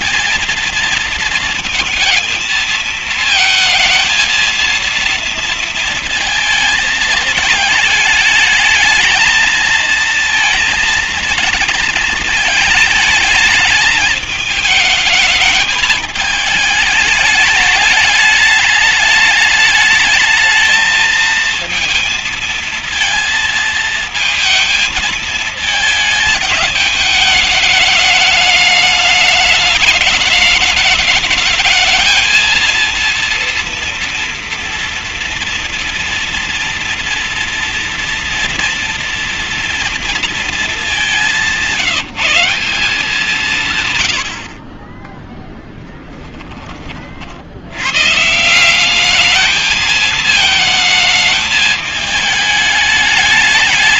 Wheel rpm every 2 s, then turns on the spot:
230, 220, 230, 220, 210, 220, 220, 210, 210, 210, 220, 220, 220, 220, 210, 210, 230, 230, 230, 230, 220, 180, 50, 40, 180, 220, 210.
none